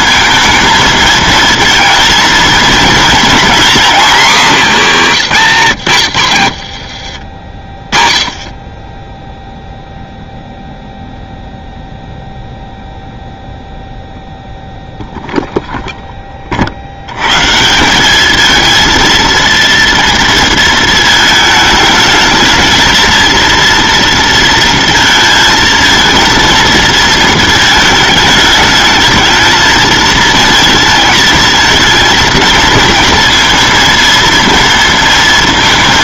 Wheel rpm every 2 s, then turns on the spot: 230, 230, 240, 90, 30, 0, 0, 0, 40, 220, 230, 220, 230, 230, 210, 220, 230, 230.
6-10